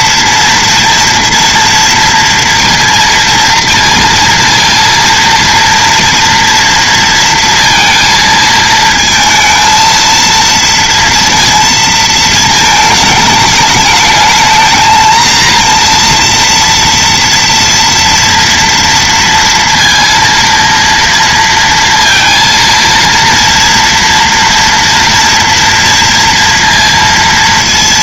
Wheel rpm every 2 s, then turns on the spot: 230, 230, 230, 230, 230, 230, 220, 230, 240, 230, 230, 230, 230, 230.
none